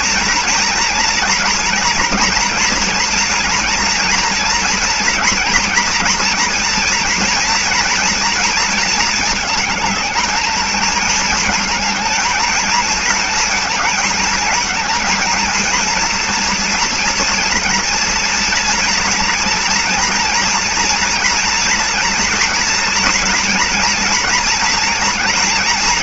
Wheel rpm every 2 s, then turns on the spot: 230, 230, 230, 230, 230, 220, 230, 220, 230, 230, 240, 230, 230.
none